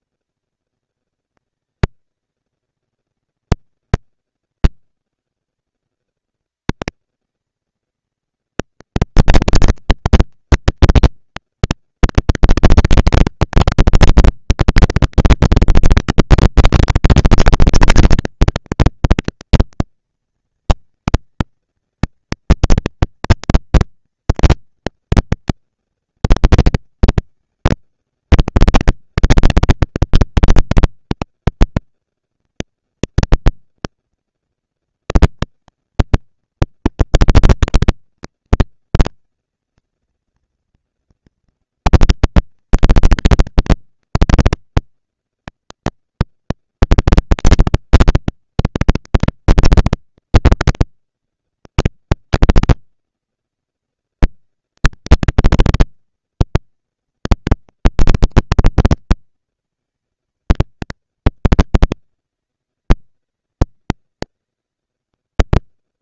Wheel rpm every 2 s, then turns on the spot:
230, 230, 190, 210, 230, 230, 230, 230, 230, 230, 230, 230, 230, 230, 210, 200, 210, 230, 230, 230, 230, 230, 230, 230, 230, 230, 230, 230, 230, 230, 220, 200, 200.
none